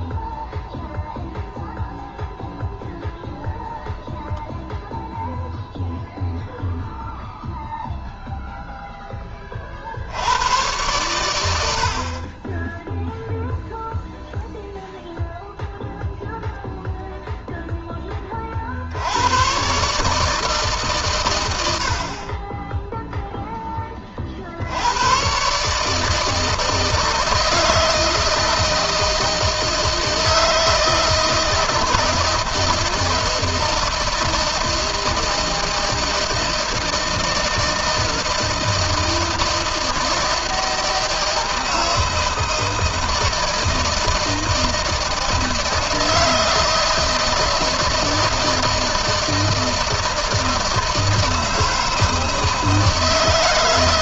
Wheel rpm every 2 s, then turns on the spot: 0, 0, 0, 0, 10, 110, 0, 0, 0, 90, 130, 10, 100, 160, 160, 160, 160, 160, 160, 160, 160, 160, 160, 160, 160, 160, 150.
none